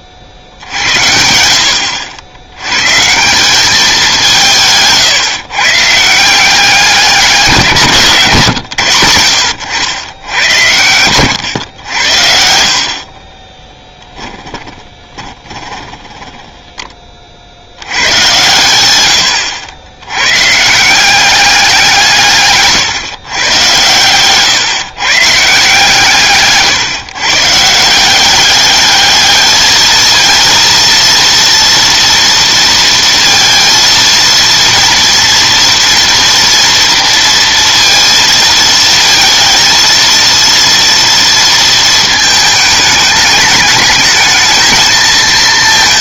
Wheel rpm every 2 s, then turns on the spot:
70, 110, 160, 180, 130, 90, 60, 20, 10, 110, 150, 140, 130, 150, 200, 230, 230, 230, 240, 220, 230, 210, 220.
14-16